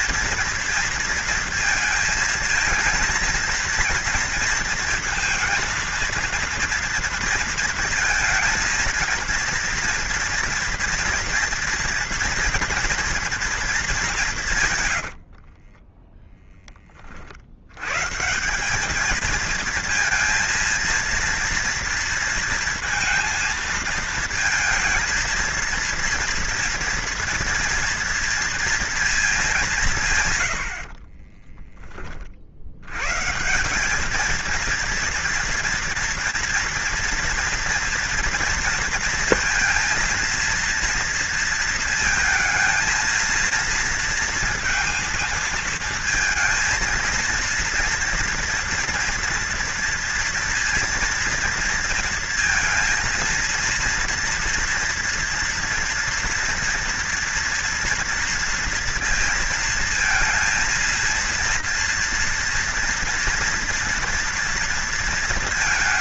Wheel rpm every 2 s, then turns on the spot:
230, 230, 230, 230, 230, 230, 230, 100, 30, 200, 230, 230, 230, 230, 230, 60, 90, 230, 230, 230, 230, 230, 230, 230, 230, 230, 230, 230, 230, 230, 230, 240, 230.
14-16